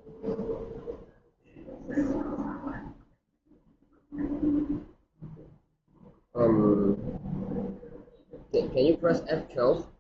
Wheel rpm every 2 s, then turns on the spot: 0, 0, 0, 0, 0.
none